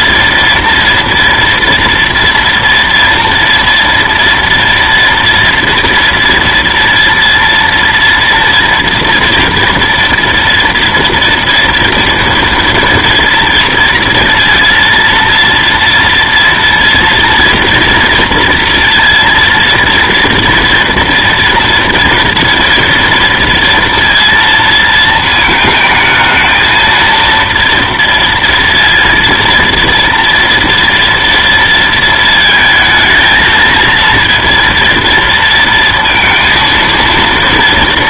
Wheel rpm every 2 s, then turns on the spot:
230, 230, 230, 230, 230, 230, 230, 230, 230, 230, 230, 230, 230, 220, 230, 230, 220, 230, 230.
none